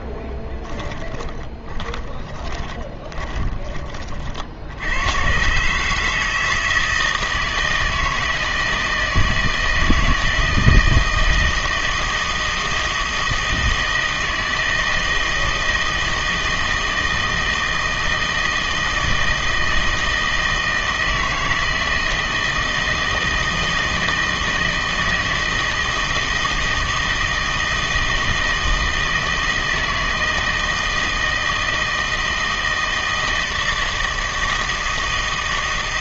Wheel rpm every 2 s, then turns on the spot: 10, 20, 70, 160, 160, 160, 160, 160, 160, 160, 160, 160, 160, 160, 160, 160, 160, 160.
0-4